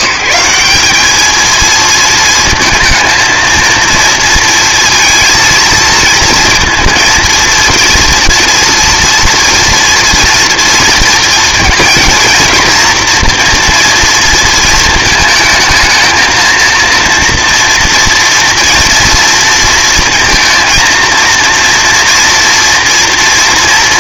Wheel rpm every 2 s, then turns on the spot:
190, 230, 230, 230, 240, 230, 240, 220, 230, 230, 230, 230.
none